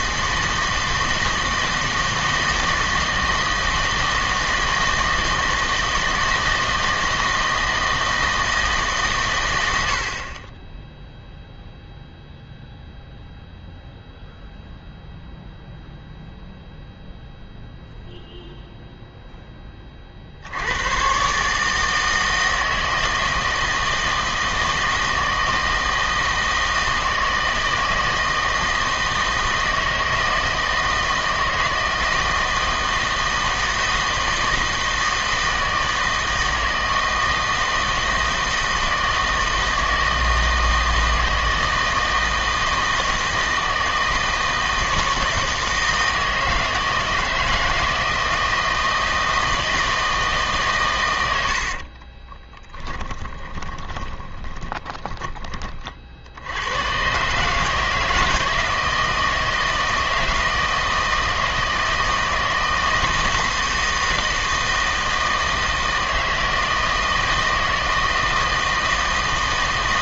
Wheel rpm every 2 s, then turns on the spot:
160, 160, 160, 160, 150, 10, 0, 0, 0, 0, 90, 160, 160, 160, 160, 160, 160, 160, 160, 160, 160, 160, 160, 160, 160, 160, 20, 10, 90, 160, 160, 160, 160, 160, 160.
52-56